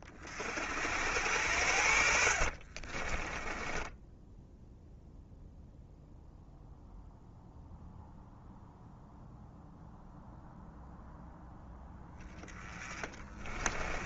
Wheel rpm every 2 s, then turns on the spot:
70, 30, 0, 0, 0, 0, 20.
2-4 12-14